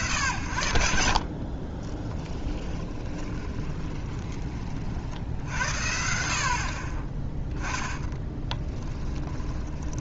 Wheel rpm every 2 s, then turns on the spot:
80, 20, 40, 40, 20.
2-4 8-10